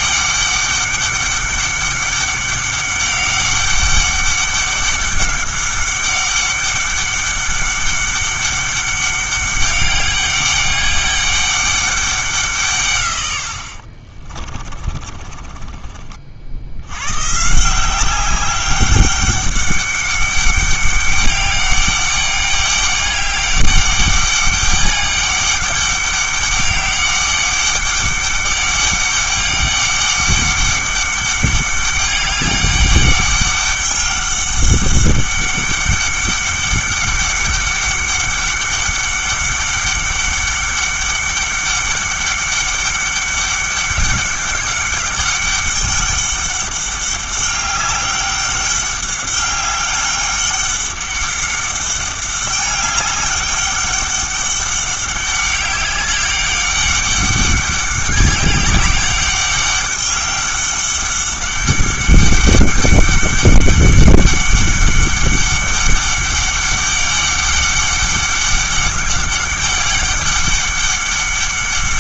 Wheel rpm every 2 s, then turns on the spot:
200, 200, 200, 200, 200, 200, 100, 30, 120, 200, 200, 200, 200, 200, 200, 200, 200, 200, 200, 200, 200, 200, 200, 200, 200, 200, 200, 200, 200, 200, 200, 200, 200, 200, 200, 200.
14-16